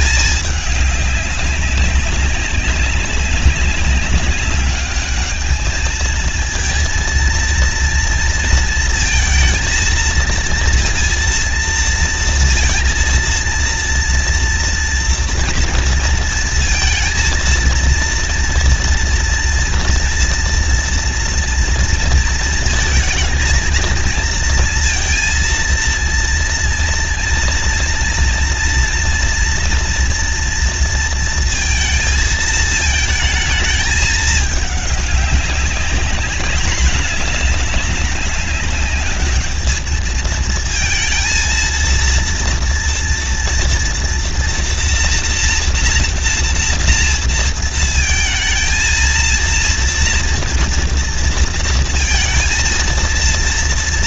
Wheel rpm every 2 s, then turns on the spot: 210, 190, 200, 220, 230, 230, 230, 230, 230, 230, 230, 230, 230, 230, 230, 230, 220, 210, 200, 200, 220, 230, 240, 230, 230, 240, 230.
none